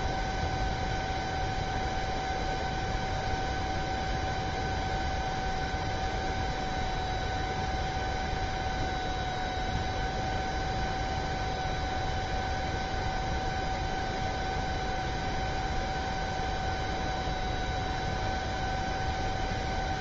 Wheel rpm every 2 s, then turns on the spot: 0, 0, 0, 0, 0, 0, 0, 0, 0, 0.
none